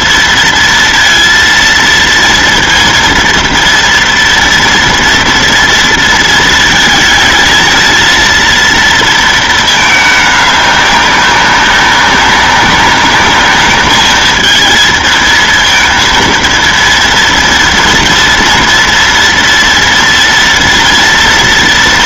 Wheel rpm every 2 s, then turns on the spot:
230, 230, 240, 220, 230, 200, 200, 220, 230, 230, 240.
none